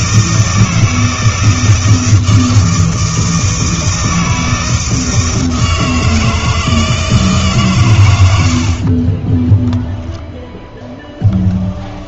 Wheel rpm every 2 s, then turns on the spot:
160, 160, 160, 160, 60, 10.
none